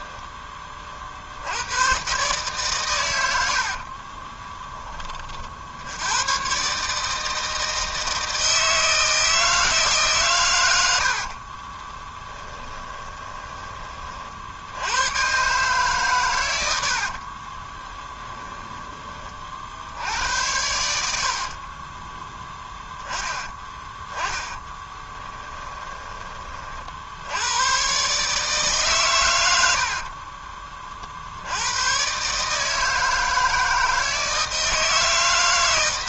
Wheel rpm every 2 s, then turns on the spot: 40, 130, 20, 150, 160, 80, 20, 90, 80, 10, 90, 10, 20, 50, 150, 40, 160, 150.
12-14 16-18 24-26